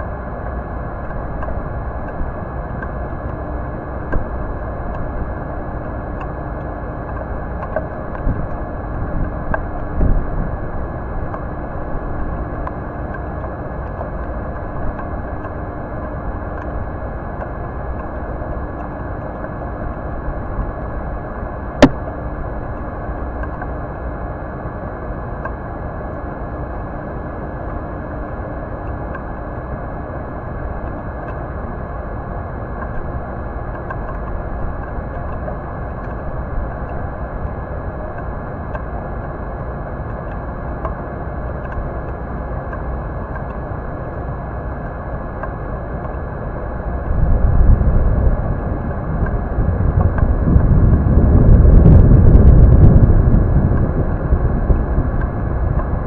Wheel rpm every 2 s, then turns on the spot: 0, 0, 0, 0, 0, 0, 0, 0, 0, 0, 0, 0, 0, 0, 0, 0, 0, 0, 0, 0, 0, 0, 0, 0, 0, 0, 0, 0.
none